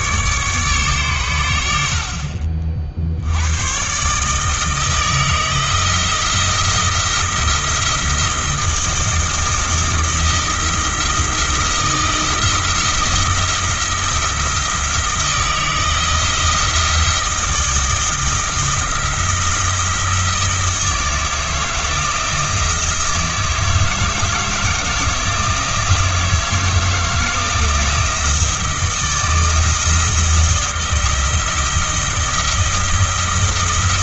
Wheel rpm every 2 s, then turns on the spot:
140, 60, 160, 170, 160, 170, 170, 160, 170, 170, 160, 160, 170, 160, 170, 170, 170.
none